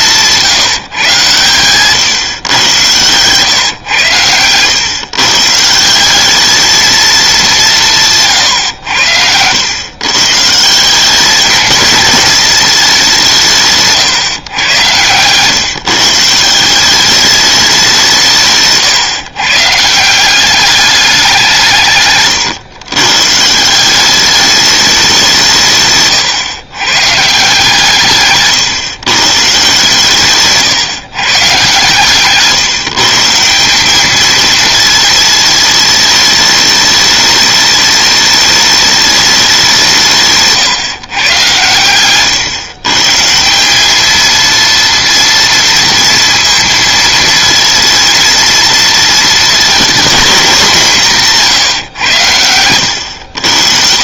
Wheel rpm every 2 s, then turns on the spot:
160, 120, 110, 220, 110, 160, 220, 130, 170, 140, 200, 120, 210, 120, 130, 140, 150, 220, 210, 210, 150, 130, 230, 220, 230, 200, 100.
none